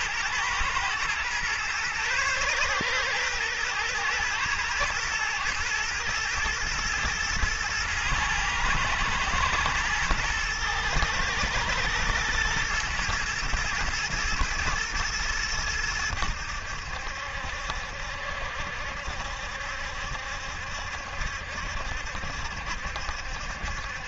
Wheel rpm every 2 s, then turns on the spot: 110, 120, 120, 110, 110, 110, 120, 110, 80, 70, 70, 70.
none